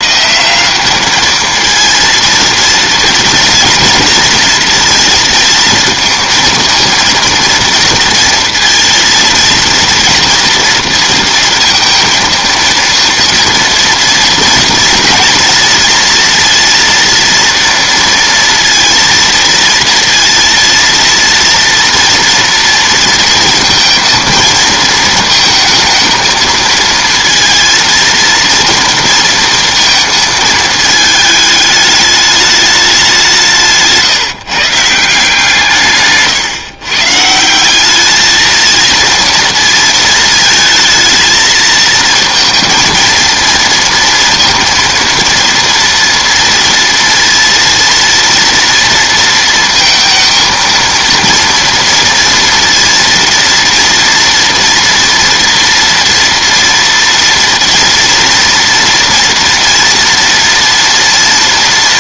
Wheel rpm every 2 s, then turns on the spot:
180, 230, 230, 230, 230, 230, 230, 230, 230, 230, 230, 230, 230, 220, 230, 220, 210, 160, 140, 220, 220, 230, 230, 230, 230, 230, 230, 230, 230, 230, 230.
none